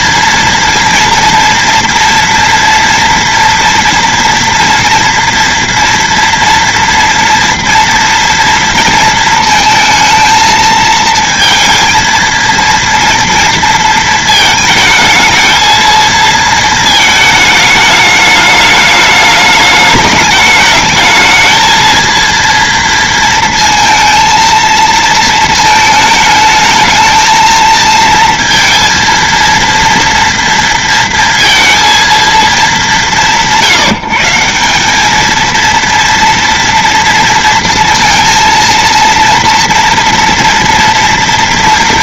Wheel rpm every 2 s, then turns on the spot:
230, 230, 230, 230, 230, 220, 230, 220, 220, 210, 210, 230, 220, 220, 230, 230, 220, 190, 230, 230, 230.
none